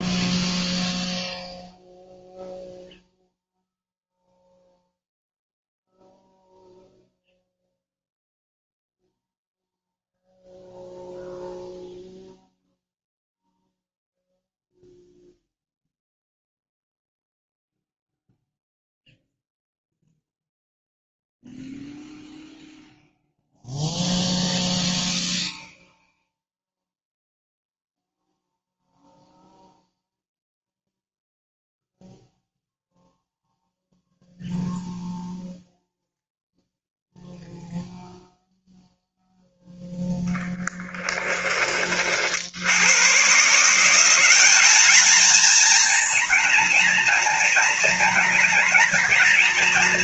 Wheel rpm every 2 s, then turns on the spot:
0, 0, 0, 0, 0, 0, 0, 0, 0, 0, 0, 0, 0, 0, 0, 0, 0, 0, 0, 0, 10, 110, 220, 230, 240.
40-42